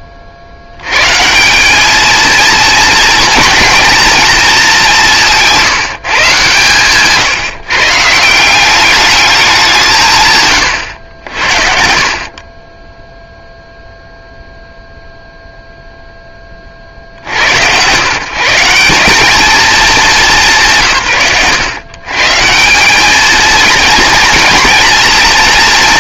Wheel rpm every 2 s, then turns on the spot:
70, 230, 210, 140, 180, 120, 20, 0, 40, 160, 100, 150, 230.
none